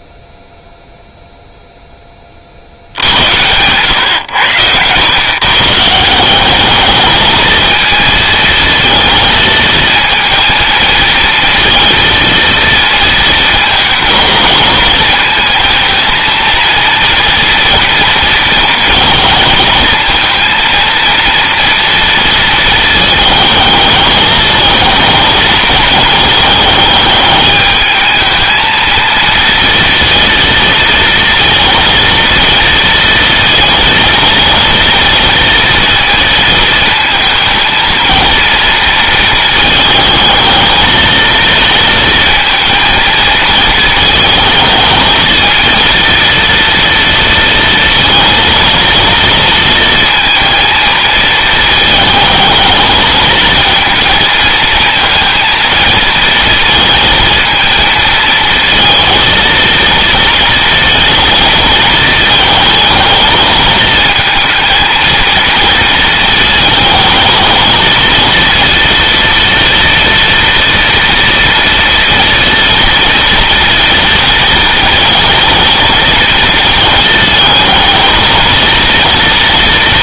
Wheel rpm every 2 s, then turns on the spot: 0, 80, 110, 210, 220, 230, 230, 230, 230, 230, 230, 220, 220, 210, 230, 230, 230, 230, 220, 230, 220, 220, 220, 230, 230, 230, 220, 230, 230, 230, 230, 220, 230, 220, 230, 230, 230, 220, 220, 230.
none